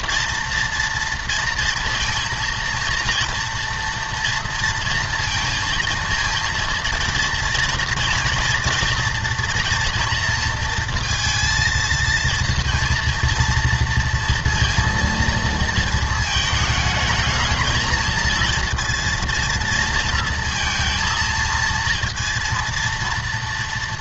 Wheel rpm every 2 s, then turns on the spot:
230, 230, 230, 230, 240, 230, 230, 230, 220, 230, 230, 230.
none